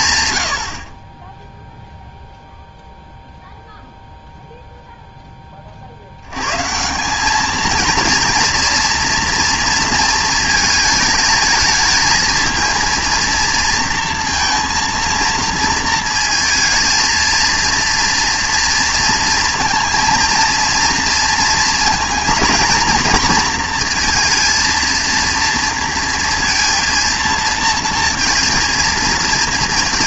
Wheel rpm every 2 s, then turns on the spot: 90, 0, 0, 130, 230, 230, 220, 230, 230, 230, 230, 230, 230, 230, 230.
none